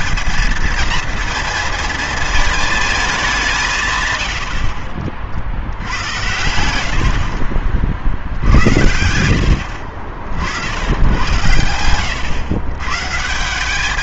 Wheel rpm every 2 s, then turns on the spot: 220, 220, 60, 80, 70, 90, 110.
none